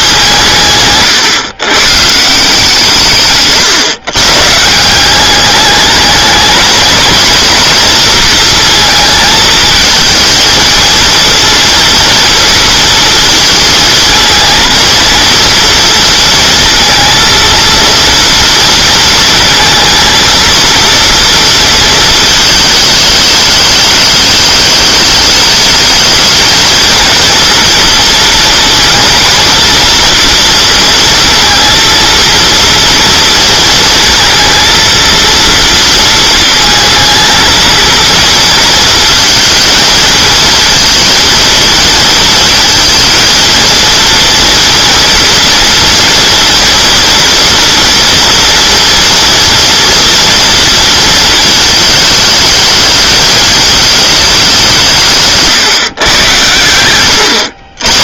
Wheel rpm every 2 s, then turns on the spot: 140, 160, 150, 220, 230, 220, 230, 230, 230, 230, 230, 220, 210, 220, 230, 230, 230, 230, 230, 230, 230, 230, 230, 230, 230, 230, 220, 180, 110.
none